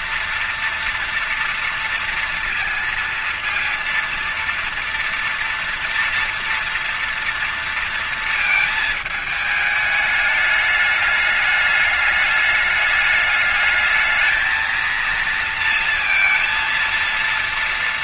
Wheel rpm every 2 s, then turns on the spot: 230, 230, 230, 240, 220, 210, 210, 220, 230.
none